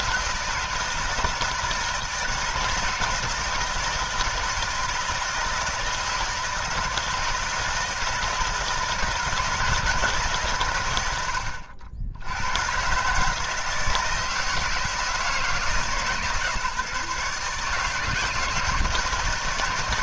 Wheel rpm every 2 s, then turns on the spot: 160, 160, 160, 160, 160, 120, 130, 160, 160, 160.
none